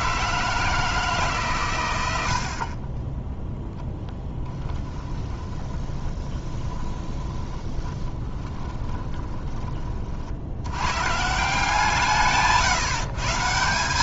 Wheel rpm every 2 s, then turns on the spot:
160, 50, 10, 20, 20, 90, 140.
2-10